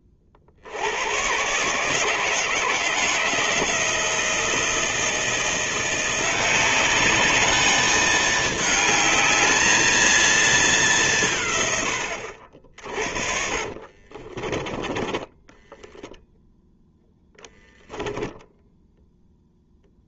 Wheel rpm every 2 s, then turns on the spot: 60, 160, 160, 190, 210, 210, 50, 20, 0, 0.
14-16